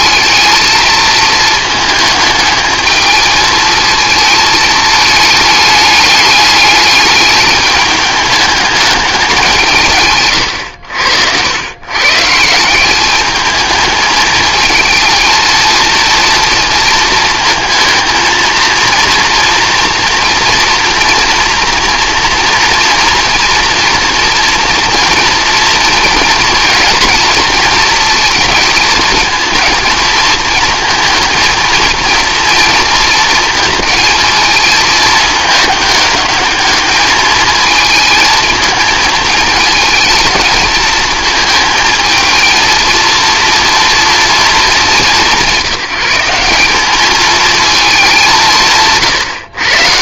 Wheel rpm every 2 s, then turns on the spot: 220, 220, 220, 210, 200, 100, 180, 220, 230, 230, 230, 230, 240, 230, 230, 230, 230, 220, 210, 220, 220, 230, 220, 200, 170.
none